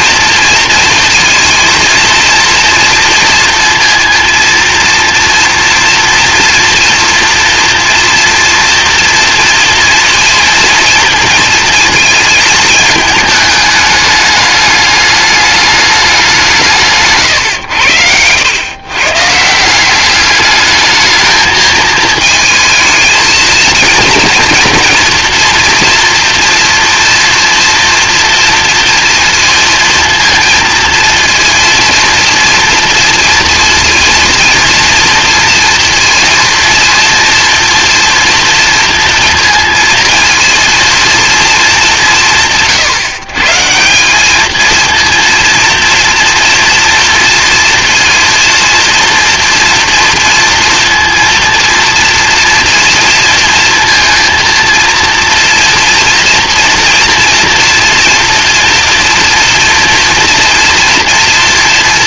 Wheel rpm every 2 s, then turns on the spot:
230, 230, 230, 230, 230, 230, 220, 210, 160, 110, 210, 220, 230, 230, 230, 230, 230, 230, 230, 230, 230, 150, 220, 230, 230, 230, 230, 230, 230, 230, 230.
none